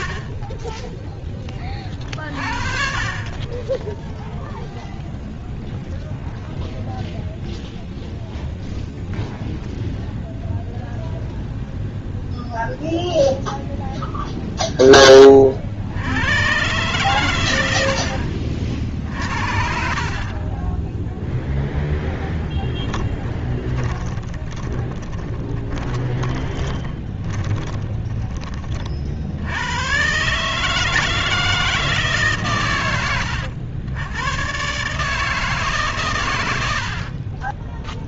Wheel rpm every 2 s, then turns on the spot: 40, 40, 0, 0, 0, 0, 0, 50, 90, 50, 0, 20, 30, 20, 100, 160, 90, 150, 20.
22-28